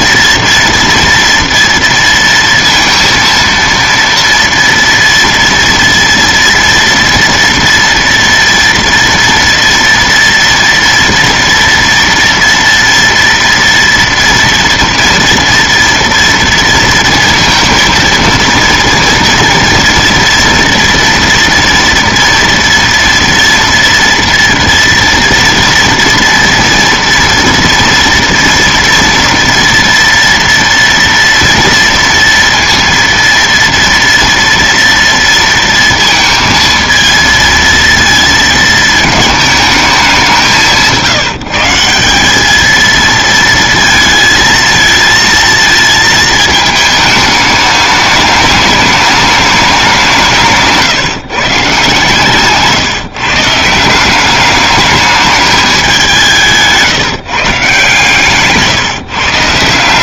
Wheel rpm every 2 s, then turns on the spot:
230, 230, 230, 230, 230, 230, 230, 230, 230, 230, 230, 230, 230, 230, 230, 230, 230, 230, 230, 230, 170, 210, 220, 220, 210, 160, 150, 200, 160, 140.
52-54 56-58